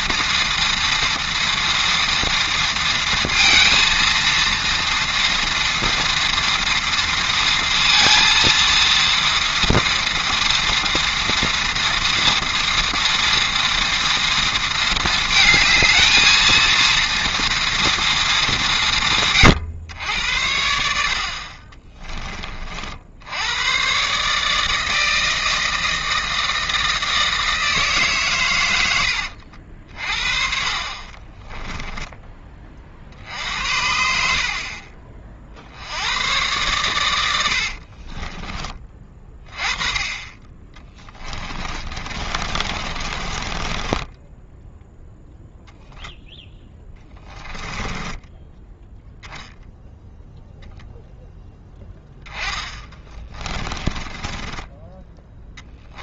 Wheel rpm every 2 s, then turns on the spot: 230, 230, 230, 230, 230, 230, 230, 230, 230, 160, 70, 60, 160, 160, 100, 40, 40, 40, 110, 20, 20, 40, 0, 10, 10, 0, 30, 10.
28-32 40-44 46-48 52-56